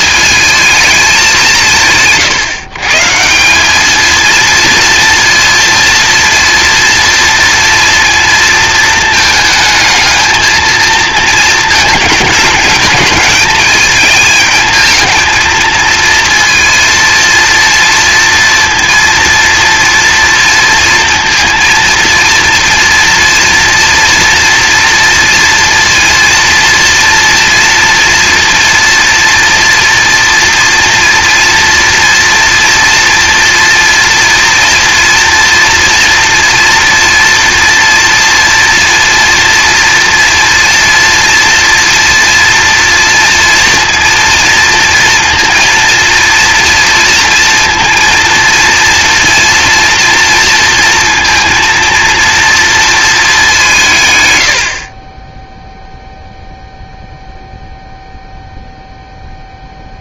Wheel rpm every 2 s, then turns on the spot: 220, 150, 230, 230, 230, 220, 220, 220, 230, 230, 230, 230, 240, 230, 230, 230, 230, 230, 230, 230, 230, 230, 220, 230, 230, 230, 230, 80, 0, 0.
none